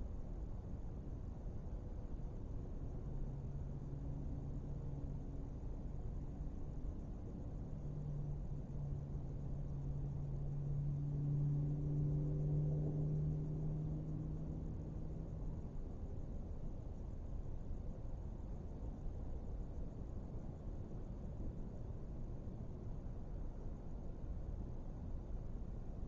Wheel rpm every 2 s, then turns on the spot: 0, 0, 0, 0, 0, 0, 0, 0, 0, 0, 0, 0, 0.
none